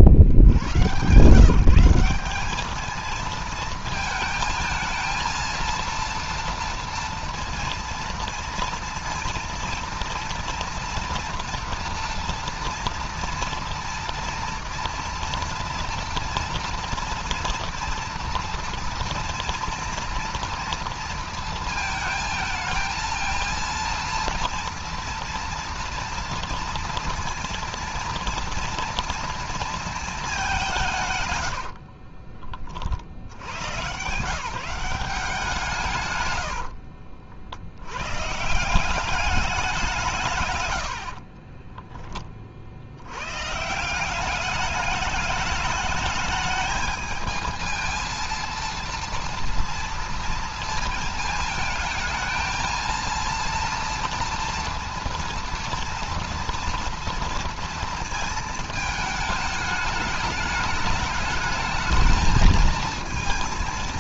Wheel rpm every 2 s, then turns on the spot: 80, 200, 230, 230, 230, 230, 230, 230, 230, 230, 230, 220, 230, 230, 230, 200, 40, 150, 100, 150, 130, 30, 200, 210, 230, 230, 230, 230, 230, 220, 210, 220.
32-34 36-38 40-42